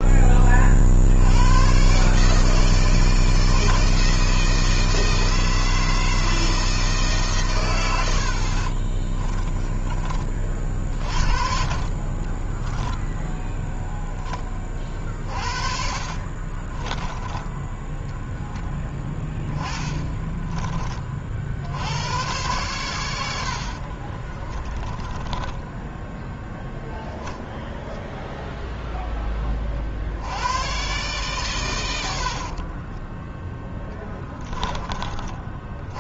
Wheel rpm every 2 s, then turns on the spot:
40, 150, 160, 160, 40, 30, 20, 20, 30, 10, 30, 110, 30, 10, 0, 90, 70, 20.
8-10 12-14 16-18 24-26